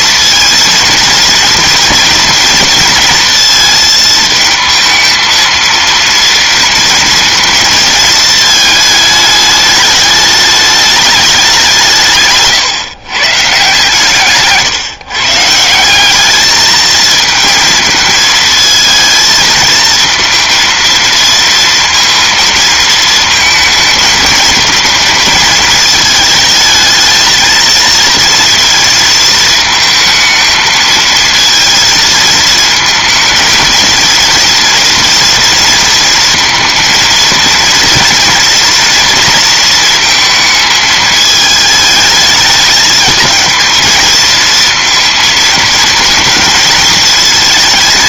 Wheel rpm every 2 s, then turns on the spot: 230, 230, 220, 230, 220, 210, 140, 140, 220, 220, 230, 220, 220, 220, 230, 230, 220, 230, 230, 230, 220, 220, 230, 220.
none